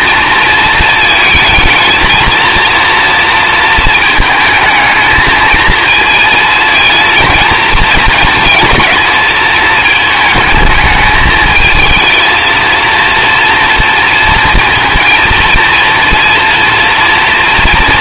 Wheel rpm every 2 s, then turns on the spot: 220, 230, 220, 220, 220, 210, 230, 230, 230.
none